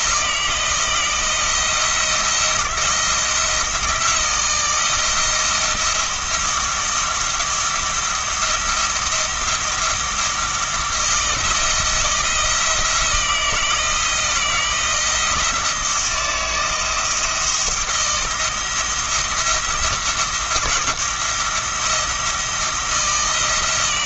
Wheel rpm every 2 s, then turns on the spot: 160, 170, 160, 170, 170, 170, 170, 170, 160, 170, 170, 160.
none